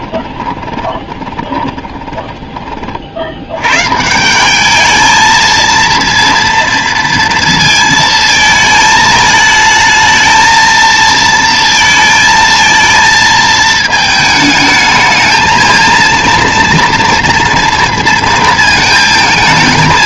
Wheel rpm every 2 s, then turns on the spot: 20, 30, 210, 230, 220, 220, 230, 220, 230, 220.
0-2